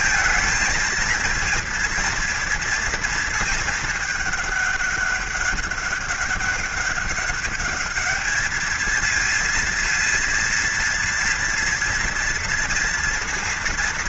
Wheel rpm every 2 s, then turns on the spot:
220, 230, 200, 200, 220, 230, 230.
none